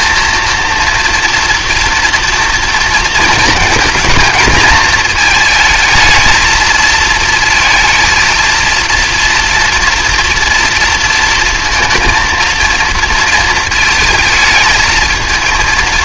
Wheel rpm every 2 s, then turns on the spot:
230, 230, 220, 220, 230, 230, 230, 220.
none